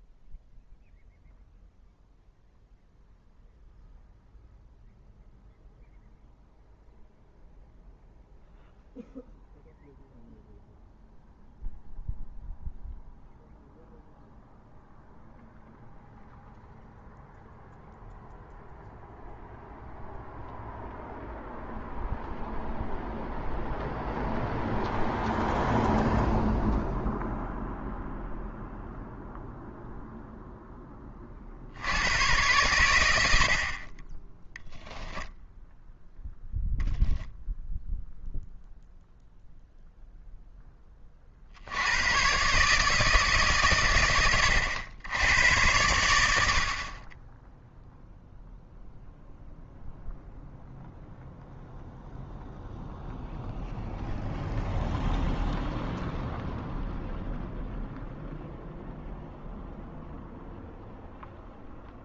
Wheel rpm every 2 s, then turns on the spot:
0, 0, 0, 0, 0, 0, 0, 0, 0, 0, 0, 0, 0, 0, 0, 10, 100, 0, 0, 0, 10, 140, 80, 60, 0, 0, 0, 0, 0, 0, 0.
none